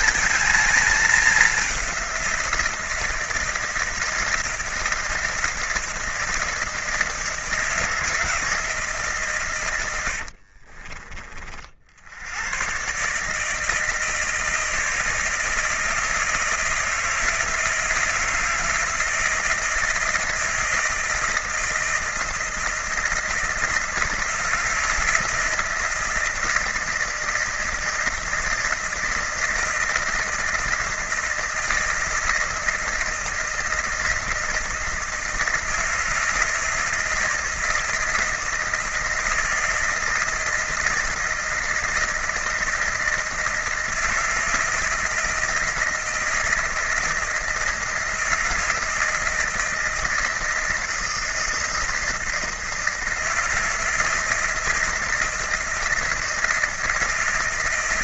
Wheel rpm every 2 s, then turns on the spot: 220, 170, 160, 160, 160, 50, 120, 160, 160, 160, 160, 160, 160, 160, 160, 160, 160, 160, 160, 160, 160, 160, 160, 160, 160, 160, 160, 160, 160.
10-12